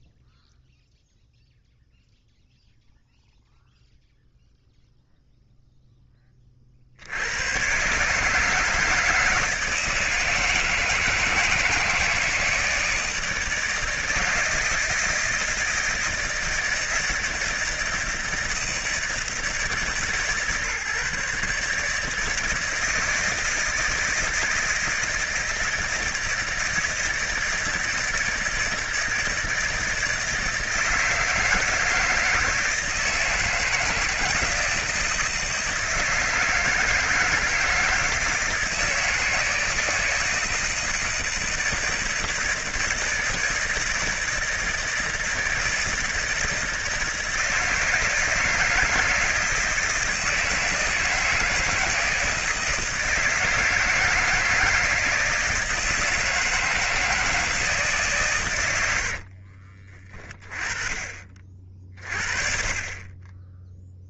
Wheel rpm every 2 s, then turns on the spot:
0, 0, 0, 30, 160, 160, 160, 160, 160, 160, 150, 160, 160, 160, 160, 160, 160, 160, 160, 160, 160, 170, 160, 160, 160, 170, 160, 160, 160, 120, 30, 40.
none